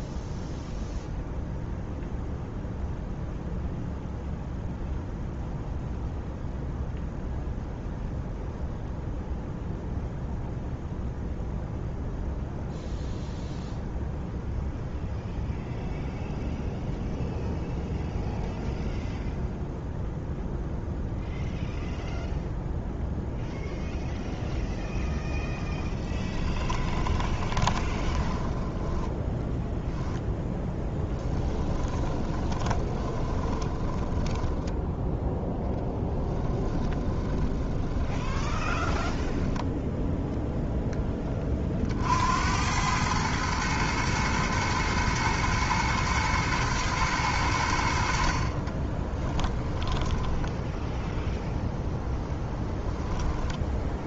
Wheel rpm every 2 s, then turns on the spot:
0, 0, 0, 0, 0, 0, 0, 0, 0, 0, 0, 0, 0, 20, 10, 10, 20, 10, 30, 10, 10, 100, 110, 110, 20, 0, 10.
26-34 36-40 48-50